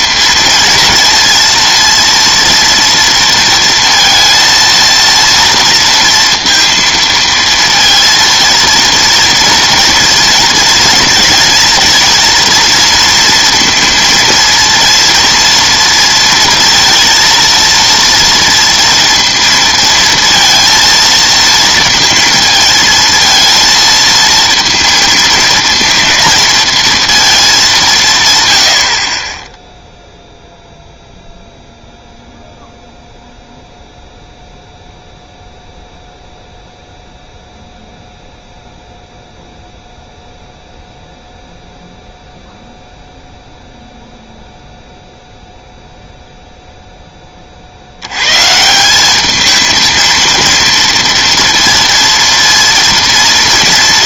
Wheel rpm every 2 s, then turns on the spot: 230, 230, 230, 230, 230, 230, 230, 230, 230, 230, 230, 230, 230, 230, 90, 0, 0, 0, 0, 0, 0, 0, 0, 0, 170, 230, 230.
none